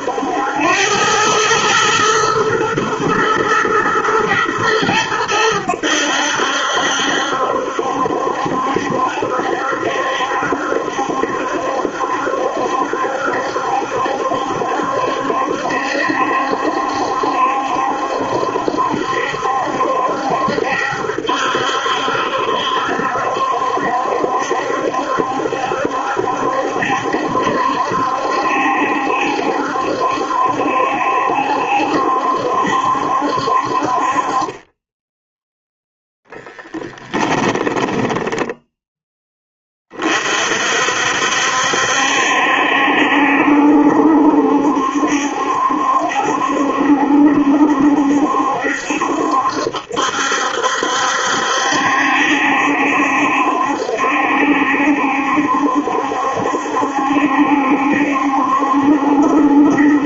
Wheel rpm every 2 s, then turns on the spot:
100, 110, 110, 70, 70, 70, 70, 70, 70, 70, 70, 70, 70, 70, 70, 70, 70, 10, 0, 0, 60, 70, 70, 70, 70, 70, 70, 70, 70, 70.
none